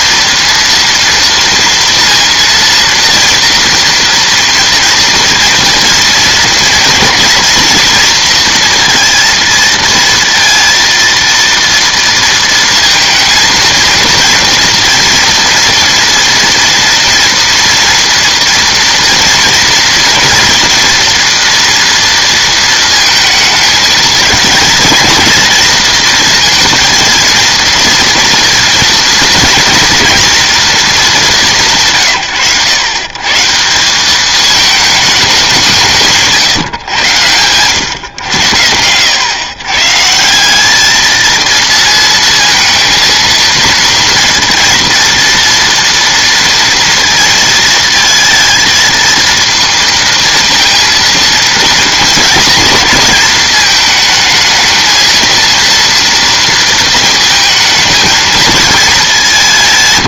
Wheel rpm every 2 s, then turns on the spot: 230, 230, 230, 230, 230, 230, 230, 230, 230, 230, 230, 230, 220, 230, 230, 240, 100, 210, 130, 90, 200, 230, 230, 230, 220, 230, 230, 220, 220, 220.
none